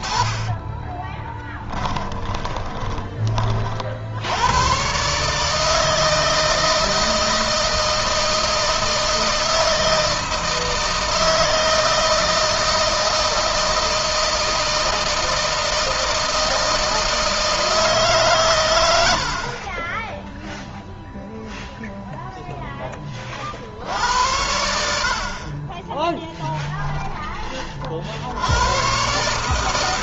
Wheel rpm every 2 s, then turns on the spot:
20, 20, 130, 160, 160, 160, 160, 160, 160, 100, 0, 20, 70, 20, 120.
0-2